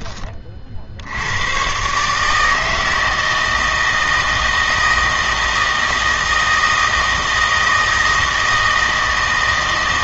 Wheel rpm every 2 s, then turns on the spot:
50, 160, 160, 160, 160.
none